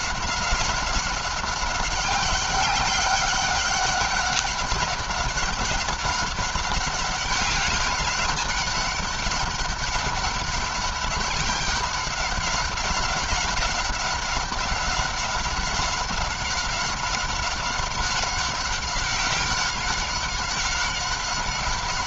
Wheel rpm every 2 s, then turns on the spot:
200, 190, 200, 200, 200, 200, 190, 190, 190, 190, 190.
none